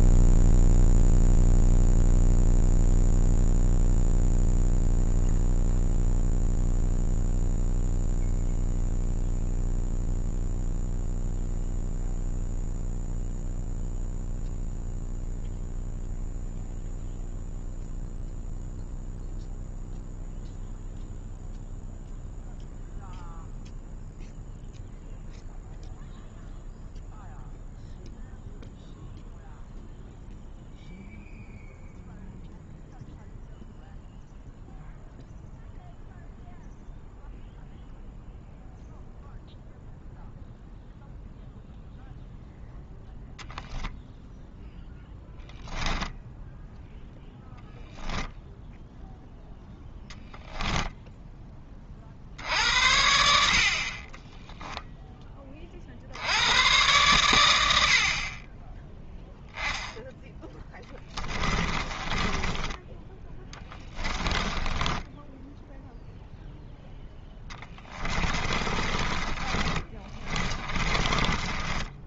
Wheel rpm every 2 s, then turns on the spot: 0, 0, 0, 0, 0, 0, 0, 0, 0, 0, 0, 0, 0, 0, 0, 0, 0, 0, 0, 0, 0, 0, 0, 0, 0, 10, 70, 10, 110, 10, 10, 20, 10, 0, 30, 20.
50-52 60-62 64-66 68-72